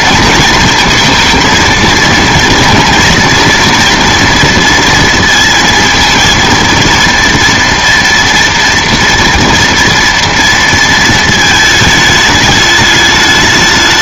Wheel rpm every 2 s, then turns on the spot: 230, 230, 230, 230, 230, 230, 210.
none